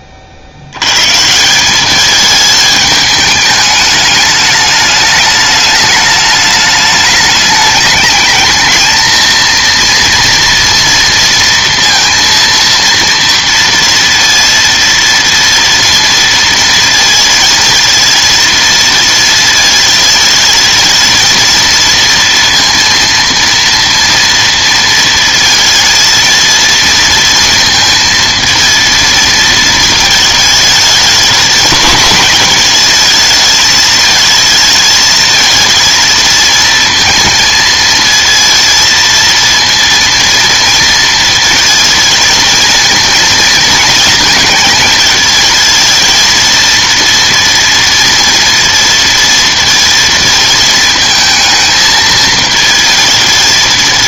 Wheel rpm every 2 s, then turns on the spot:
80, 210, 210, 210, 220, 230, 230, 230, 230, 230, 220, 230, 230, 230, 230, 220, 230, 220, 230, 230, 230, 230, 220, 230, 230, 220, 220.
none